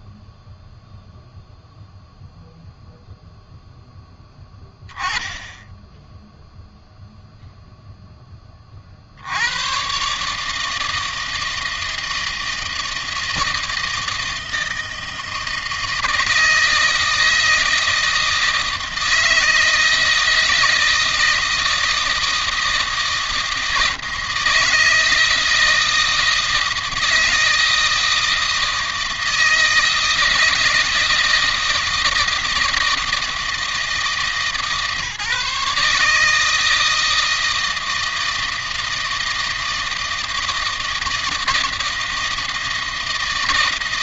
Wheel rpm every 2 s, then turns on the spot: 0, 0, 10, 0, 50, 160, 160, 160, 160, 160, 160, 160, 160, 160, 160, 160, 160, 150, 160, 160, 160, 160.
none